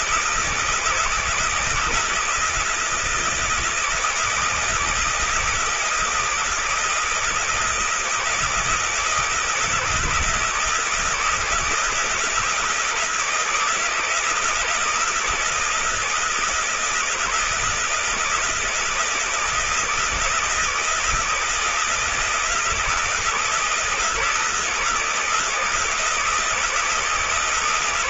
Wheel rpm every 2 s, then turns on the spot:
160, 160, 160, 160, 160, 160, 170, 160, 160, 160, 160, 160, 160, 160.
none